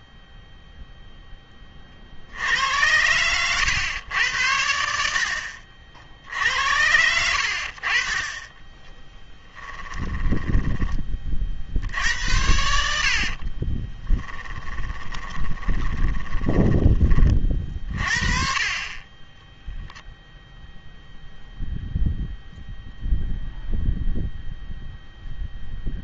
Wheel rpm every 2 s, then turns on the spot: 0, 90, 80, 80, 10, 20, 70, 20, 20, 30, 0, 0, 0.
8-10 12-16